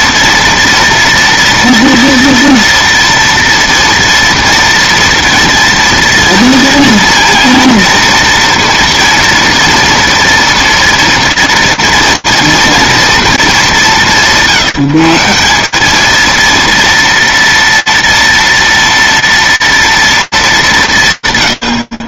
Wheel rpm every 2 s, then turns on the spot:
230, 230, 230, 230, 240, 230, 200, 170, 230, 230, 160.
none